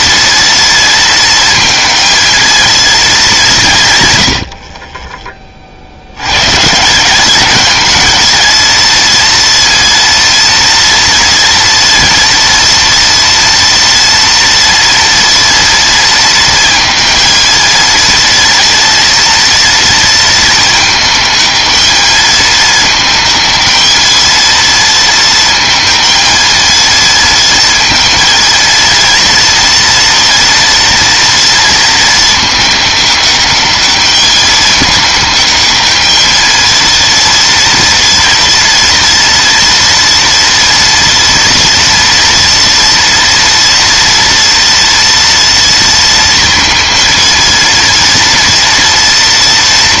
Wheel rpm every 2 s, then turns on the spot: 230, 230, 70, 140, 230, 230, 230, 230, 220, 230, 220, 220, 230, 230, 230, 230, 210, 210, 230, 230, 230, 240, 230, 230, 230.
none